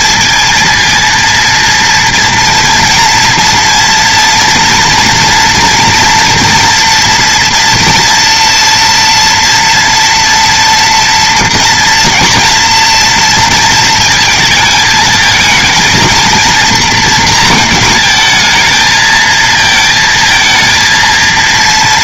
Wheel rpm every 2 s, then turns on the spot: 230, 230, 240, 230, 230, 230, 230, 220, 230, 220, 230.
none